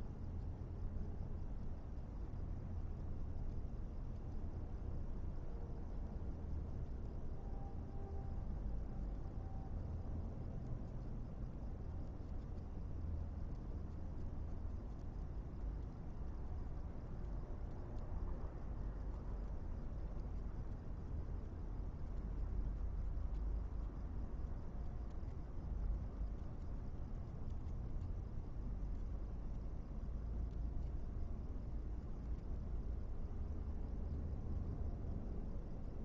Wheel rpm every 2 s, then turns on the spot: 0, 0, 0, 0, 0, 0, 0, 0, 0, 0, 0, 0, 0, 0, 0, 0, 0, 0.
none